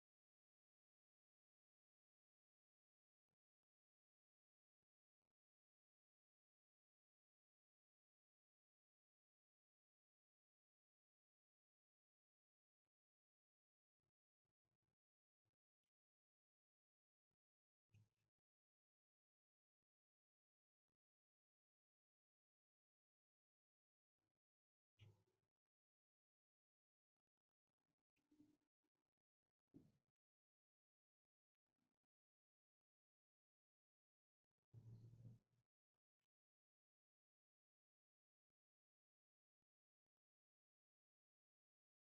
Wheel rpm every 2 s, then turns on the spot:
0, 0, 0, 0, 0, 0, 0, 0, 0, 0, 0, 0, 0, 0, 0, 0, 0, 0, 0, 0, 0.
none